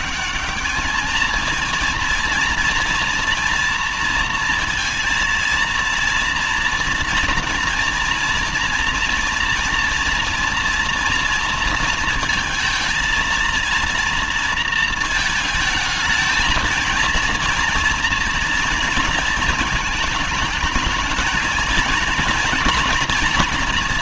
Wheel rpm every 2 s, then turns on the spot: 210, 230, 230, 240, 230, 230, 230, 230, 220, 230, 220, 240.
none